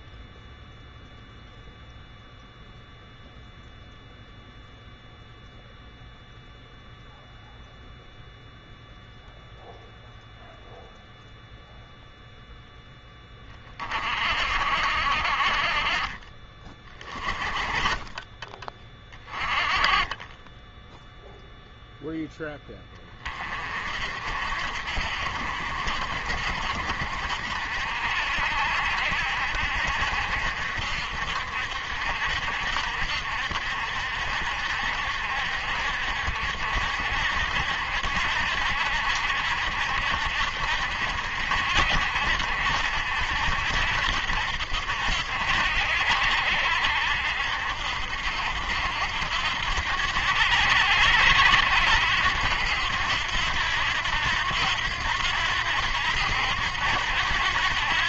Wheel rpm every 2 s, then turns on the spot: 0, 0, 0, 0, 0, 0, 0, 60, 30, 20, 10, 20, 60, 60, 60, 60, 70, 60, 70, 70, 70, 70, 70, 70, 70, 80, 90, 90, 90.
none